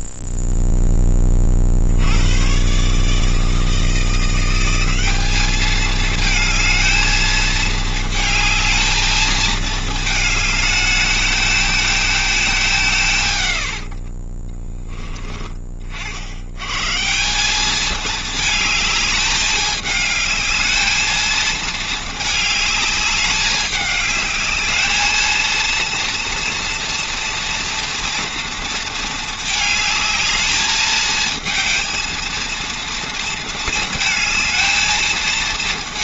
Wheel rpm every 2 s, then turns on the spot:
0, 40, 160, 210, 220, 220, 220, 100, 30, 200, 210, 220, 210, 230, 230, 220, 230, 230.
none